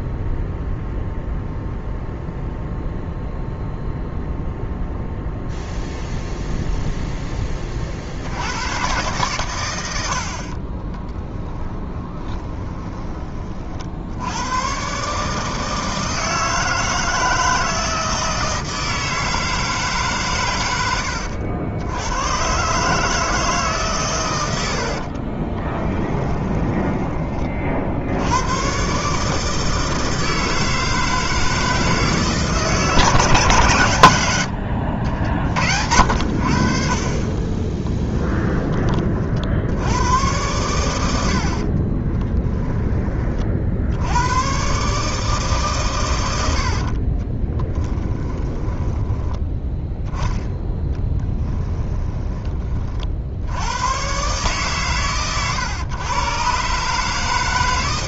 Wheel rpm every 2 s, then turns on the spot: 0, 0, 0, 0, 110, 40, 20, 110, 160, 160, 110, 140, 80, 10, 120, 160, 160, 70, 50, 20, 100, 10, 120, 70, 10, 10, 30, 140, 140.
10-14 24-28 46-50